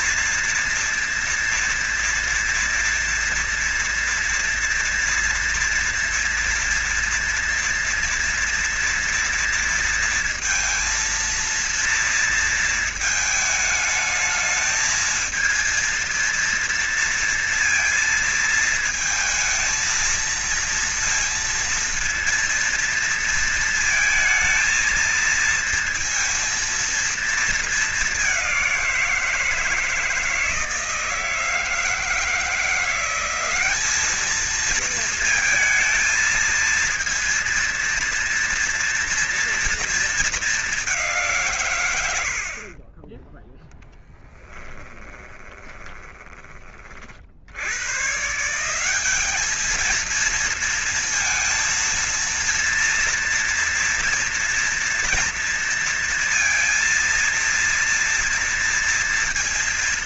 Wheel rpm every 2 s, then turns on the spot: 230, 230, 230, 230, 230, 230, 230, 220, 230, 220, 220, 230, 220, 230, 200, 160, 160, 210, 230, 230, 210, 60, 10, 20, 140, 220, 230, 230, 230, 230.
44-46